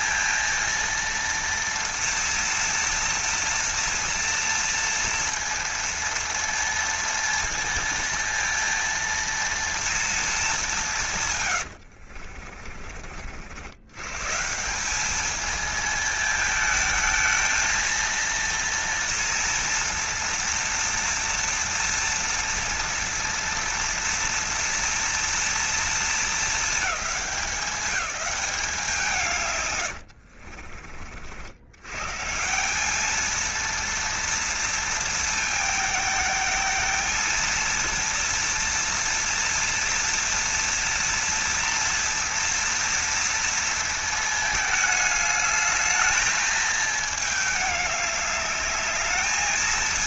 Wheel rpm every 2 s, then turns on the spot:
230, 230, 230, 230, 230, 190, 50, 170, 220, 230, 230, 230, 230, 220, 180, 40, 180, 230, 220, 230, 230, 230, 210, 220, 210.
12-14